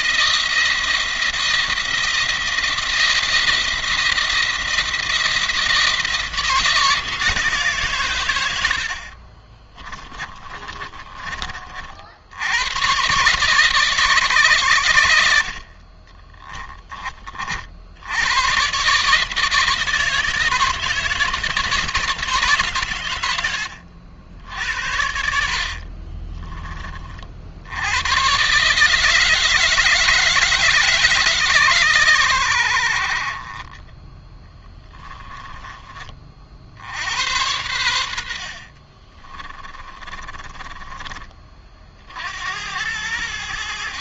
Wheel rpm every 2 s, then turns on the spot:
170, 170, 170, 160, 50, 30, 120, 110, 20, 140, 160, 130, 70, 40, 150, 150, 60, 10, 80, 40, 20, 80.
8-10 14-16 24-26 34-36 38-40